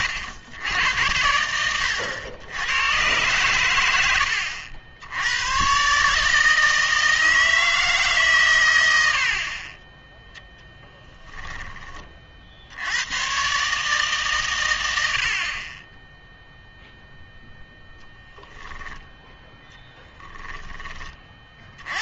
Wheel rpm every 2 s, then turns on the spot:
110, 110, 70, 160, 120, 10, 70, 120, 0, 10, 10.
18-20